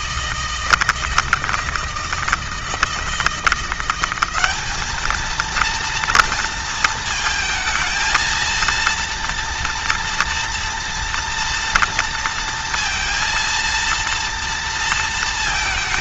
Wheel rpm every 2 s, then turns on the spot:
160, 160, 210, 220, 230, 230, 230, 230.
none